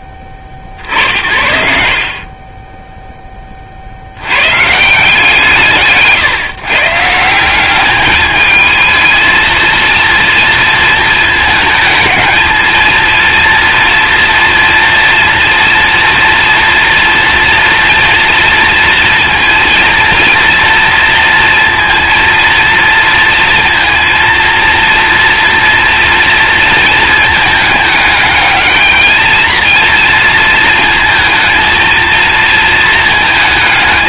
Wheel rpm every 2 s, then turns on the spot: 50, 10, 150, 150, 220, 220, 230, 230, 230, 230, 230, 230, 230, 230, 220, 220, 220.
none